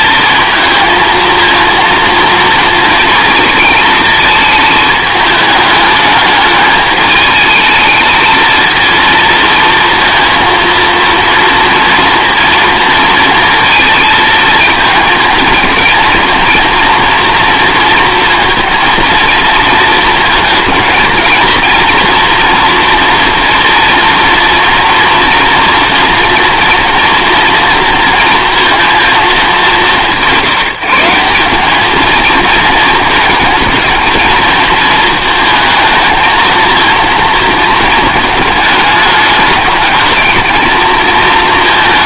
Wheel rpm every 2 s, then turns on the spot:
230, 230, 220, 210, 230, 230, 230, 220, 230, 230, 220, 230, 230, 230, 230, 170, 220, 220, 220, 210, 220.
none